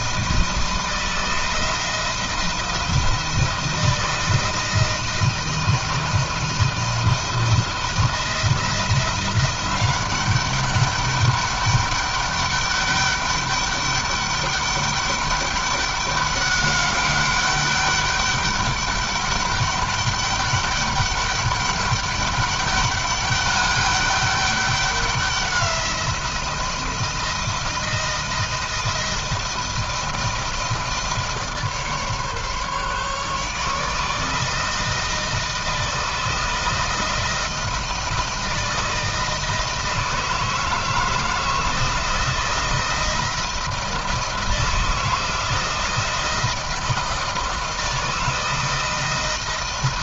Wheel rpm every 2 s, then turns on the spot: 160, 170, 160, 170, 170, 200, 200, 200, 200, 200, 200, 200, 200, 160, 160, 160, 150, 160, 160, 160, 160, 170, 160, 170, 160.
none